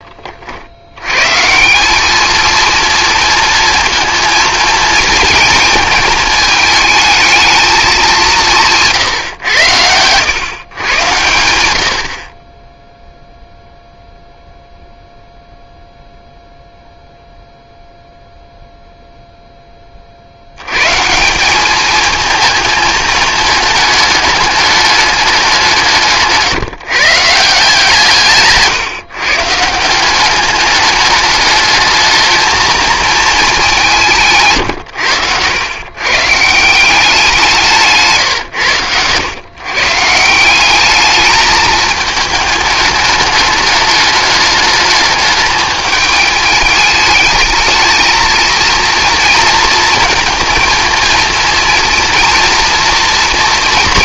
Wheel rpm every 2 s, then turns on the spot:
70, 230, 230, 220, 170, 130, 20, 0, 0, 0, 100, 220, 210, 150, 140, 210, 220, 130, 160, 110, 190, 210, 210, 210, 230, 230, 230.
none